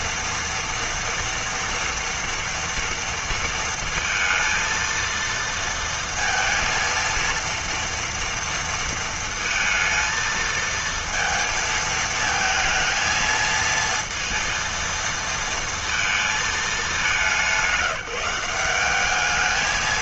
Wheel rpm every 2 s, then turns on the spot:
230, 230, 230, 230, 230, 230, 230, 230, 200, 190.
none